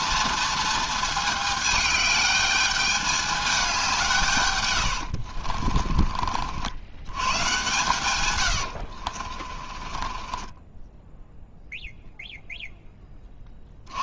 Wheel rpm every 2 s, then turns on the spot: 230, 210, 100, 80, 90, 10, 0.
4-6 8-12